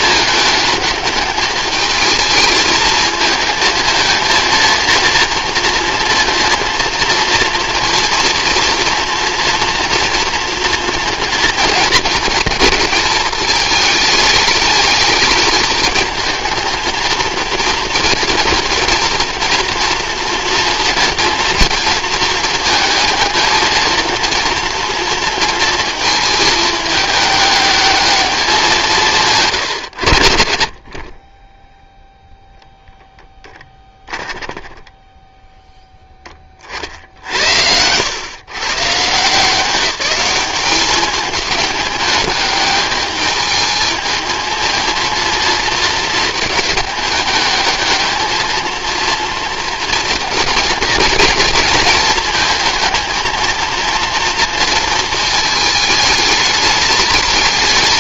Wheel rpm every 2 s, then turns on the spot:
210, 220, 230, 230, 230, 230, 220, 210, 220, 230, 230, 220, 230, 210, 180, 50, 0, 10, 50, 140, 200, 210, 230, 210, 220, 220, 220, 230, 220.
34-36